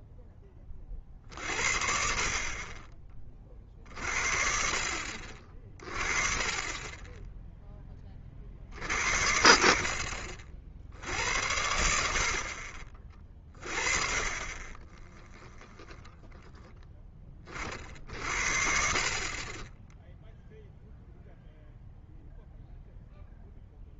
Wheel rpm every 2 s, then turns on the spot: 20, 40, 60, 20, 60, 80, 40, 20, 20, 60, 0, 0.
none